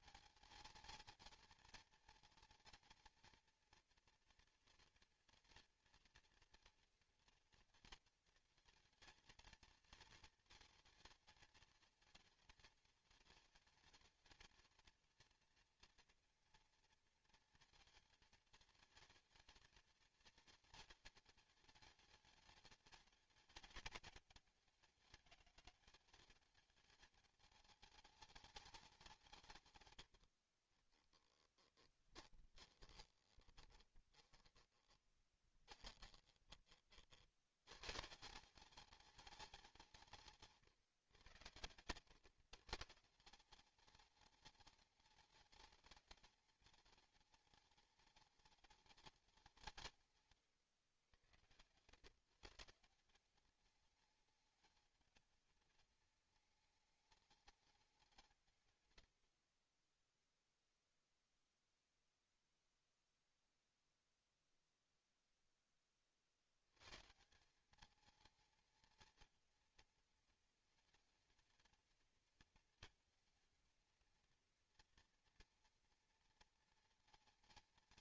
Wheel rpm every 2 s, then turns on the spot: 220, 230, 230, 230, 220, 230, 220, 220, 230, 220, 220, 210, 200, 210, 210, 40, 30, 20, 30, 190, 150, 150, 210, 210, 210, 110, 170, 220, 220, 120, 0, 0, 0, 100, 220, 220, 230, 230, 230.
30-36